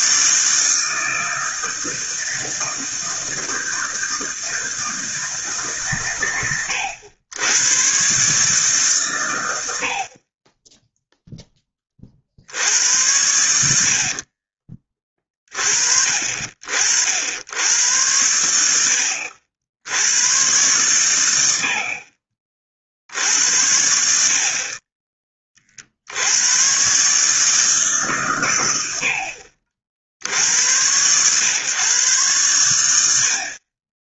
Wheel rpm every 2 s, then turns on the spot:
160, 160, 160, 100, 140, 10, 80, 30, 60, 80, 110, 50, 30, 130, 90, 90, 80.
none